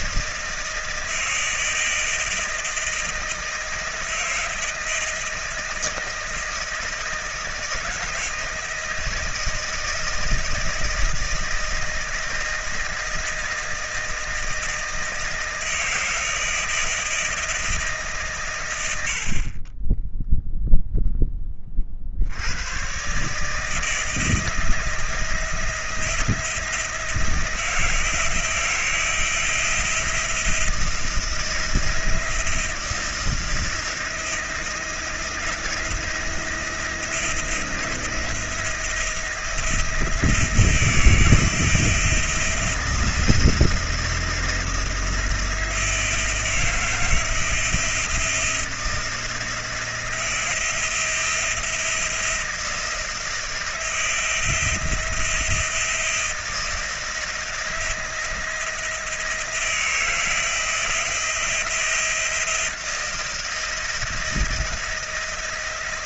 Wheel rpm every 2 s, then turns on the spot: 160, 160, 160, 160, 160, 160, 160, 160, 160, 140, 10, 70, 160, 170, 170, 170, 160, 170, 170, 170, 170, 170, 170, 160, 160, 170, 160, 170, 160, 170, 170, 170, 170.
none